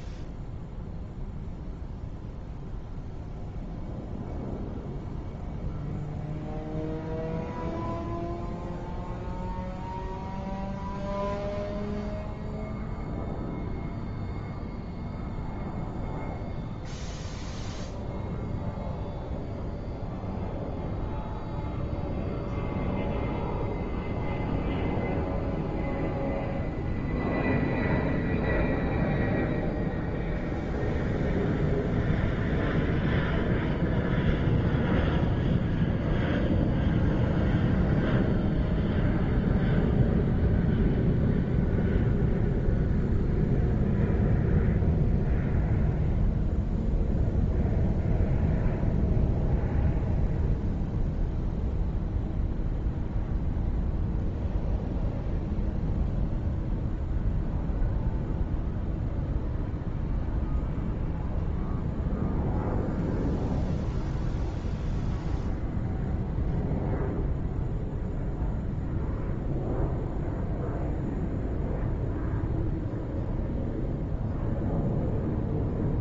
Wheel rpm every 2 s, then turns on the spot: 0, 0, 0, 0, 0, 0, 0, 0, 0, 0, 0, 0, 0, 0, 0, 0, 0, 0, 0, 0, 0, 0, 0, 0, 0, 0, 0, 0, 0, 0, 0, 0, 0, 0, 0, 0, 0, 0.
none